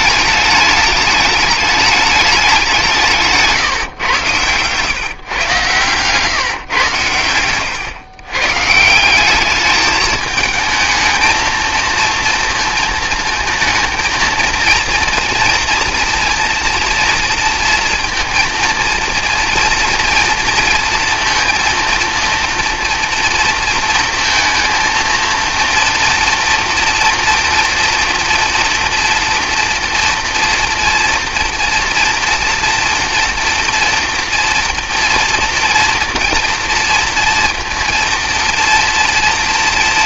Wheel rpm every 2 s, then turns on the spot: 210, 180, 120, 120, 160, 220, 230, 230, 230, 230, 230, 230, 230, 230, 230, 230, 230, 230, 230, 230.
none